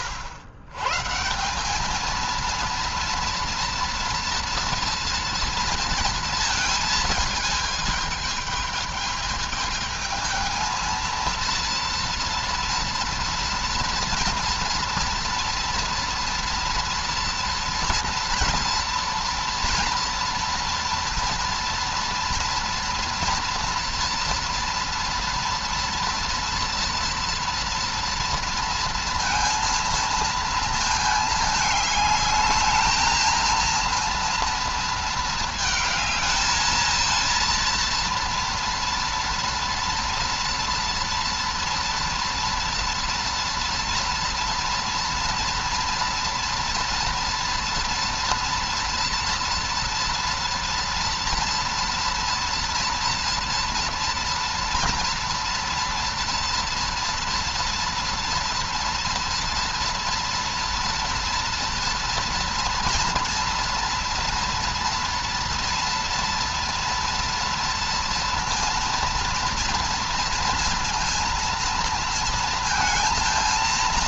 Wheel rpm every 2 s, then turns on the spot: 120, 230, 230, 220, 220, 230, 240, 230, 230, 230, 230, 230, 230, 230, 230, 220, 220, 220, 220, 230, 240, 230, 230, 230, 230, 230, 230, 230, 230, 230, 230, 230, 240, 230, 230, 230, 230.
none